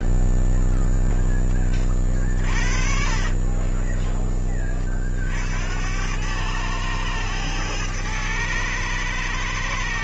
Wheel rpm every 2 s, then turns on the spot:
0, 50, 30, 100, 110.
none